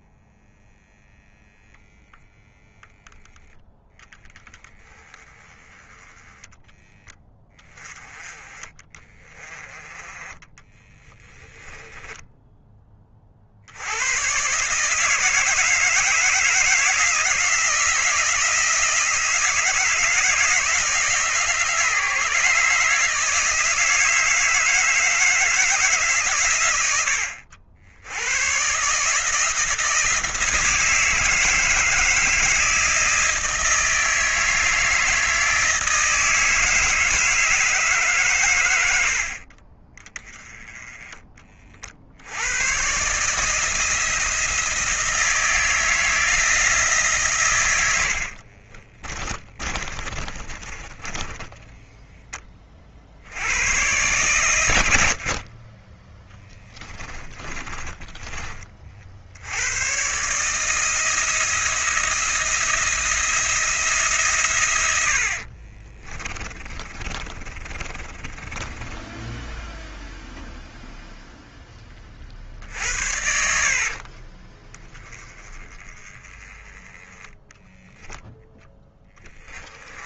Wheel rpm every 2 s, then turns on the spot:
0, 0, 10, 10, 30, 20, 20, 150, 170, 170, 160, 150, 160, 100, 140, 160, 160, 160, 160, 90, 10, 120, 160, 160, 40, 20, 40, 90, 20, 40, 160, 170, 100, 30, 10, 0, 60, 20, 10, 10.
10-12 48-52 56-58 66-70